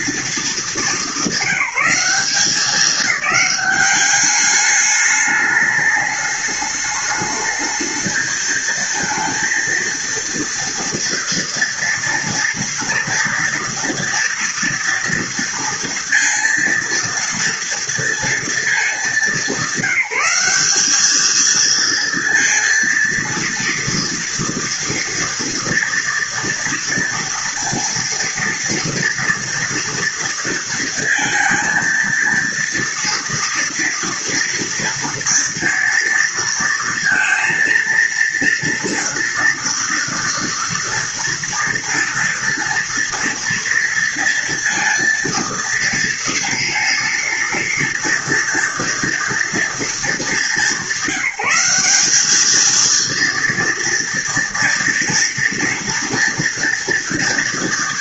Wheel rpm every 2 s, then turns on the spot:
220, 200, 200, 210, 220, 230, 230, 230, 230, 220, 200, 230, 230, 230, 230, 230, 230, 230, 230, 230, 240, 230, 230, 230, 230, 210, 220, 230, 230.
none